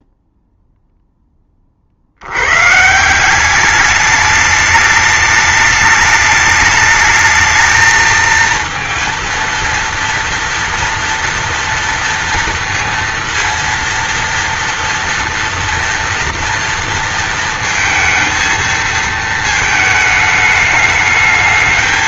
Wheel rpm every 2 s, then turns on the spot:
0, 150, 210, 210, 230, 230, 230, 230, 230, 220, 210.
none